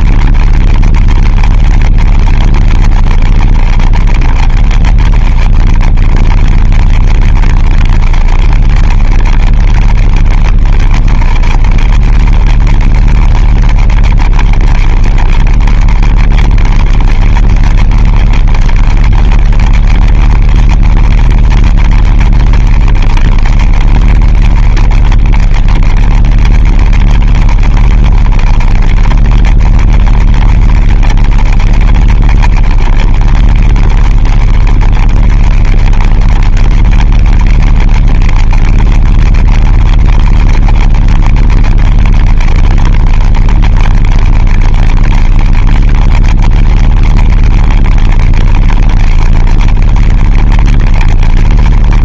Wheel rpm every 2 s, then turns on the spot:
30, 30, 30, 30, 30, 30, 30, 30, 30, 30, 30, 30, 30, 30, 30, 30, 30, 30, 30, 30, 30, 30, 30, 30, 30, 30.
none